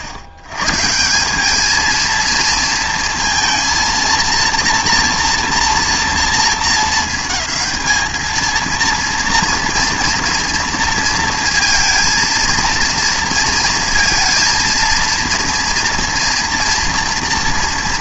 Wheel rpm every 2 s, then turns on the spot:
110, 230, 230, 230, 230, 230, 230, 230, 230.
none